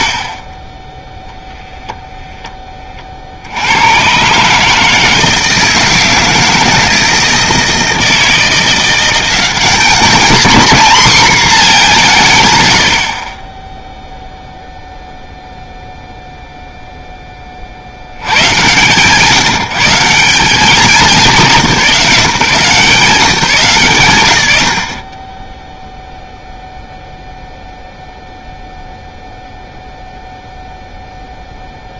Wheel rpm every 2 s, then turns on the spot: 20, 20, 150, 160, 170, 240, 100, 0, 0, 140, 190, 160, 40, 0, 0, 0.
none